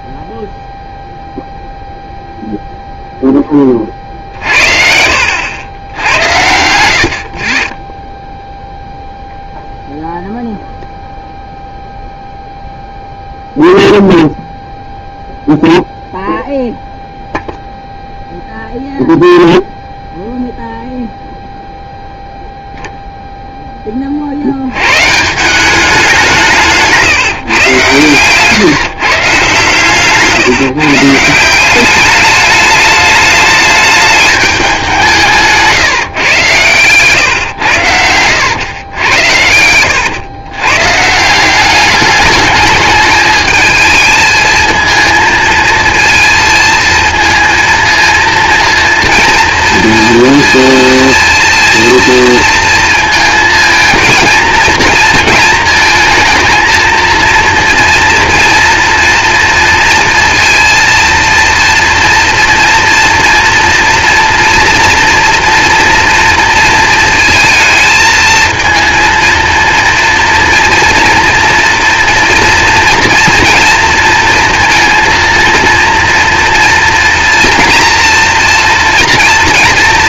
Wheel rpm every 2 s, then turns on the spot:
0, 0, 60, 80, 0, 0, 0, 0, 0, 0, 0, 0, 100, 160, 140, 150, 210, 190, 130, 100, 130, 210, 220, 220, 230, 230, 230, 220, 230, 240, 230, 230, 240, 230, 230, 230, 230, 230, 230, 230.
36-38